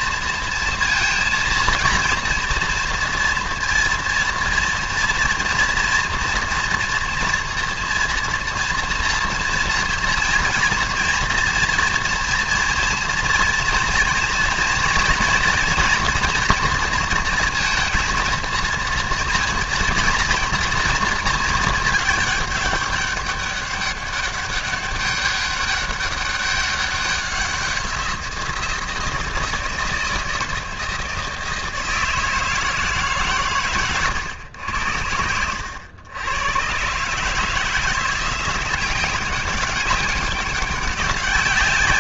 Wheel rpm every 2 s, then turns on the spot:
230, 230, 230, 240, 230, 240, 230, 230, 230, 230, 230, 200, 200, 200, 170, 160, 160, 90, 120, 180, 200.
none